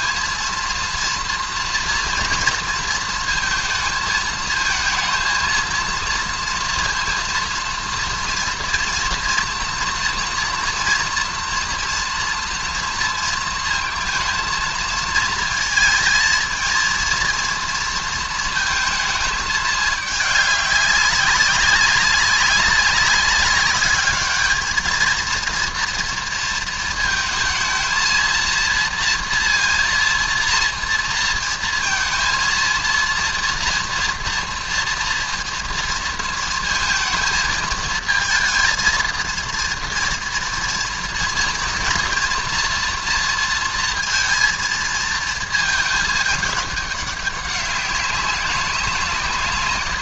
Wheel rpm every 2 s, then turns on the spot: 230, 230, 220, 230, 230, 230, 230, 230, 230, 220, 200, 200, 220, 230, 230, 230, 230, 230, 220, 230, 230, 230, 220, 200, 180.
none